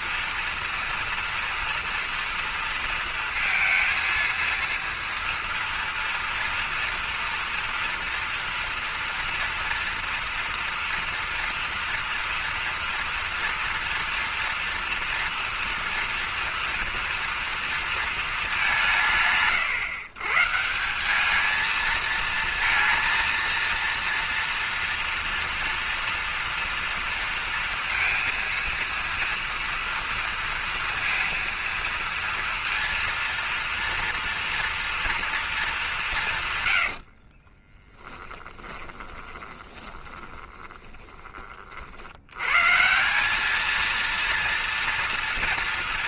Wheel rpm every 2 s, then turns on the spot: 230, 230, 230, 230, 230, 230, 230, 230, 230, 200, 160, 230, 230, 230, 230, 230, 230, 230, 130, 20, 20, 130, 230.
38-42